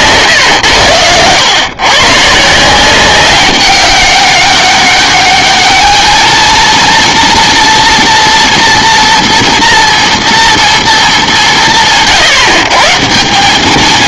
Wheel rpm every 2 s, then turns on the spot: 120, 170, 200, 230, 230, 230, 140.
none